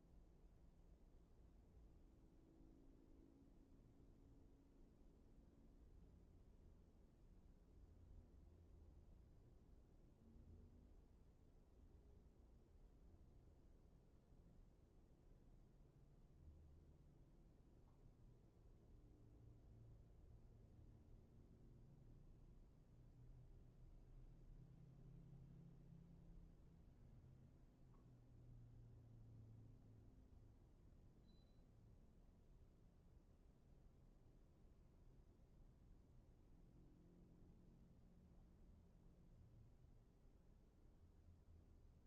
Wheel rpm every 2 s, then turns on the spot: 0, 0, 0, 0, 0, 0, 0, 0, 0, 0, 0, 0, 0, 0, 0, 0, 0, 0, 0, 0, 0.
none